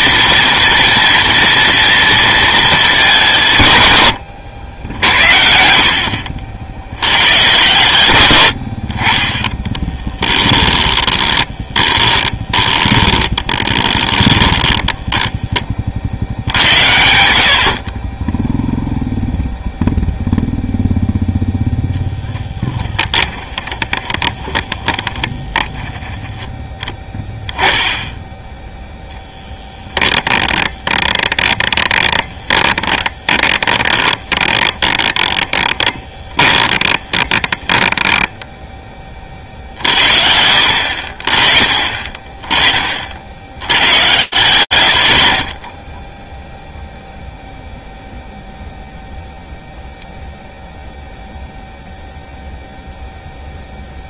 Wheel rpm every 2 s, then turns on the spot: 230, 220, 80, 70, 70, 20, 20, 20, 80, 0, 0, 10, 20, 10, 0, 30, 20, 30, 20, 10, 50, 30, 100, 0, 0, 0, 0.
10-16 22-26 30-38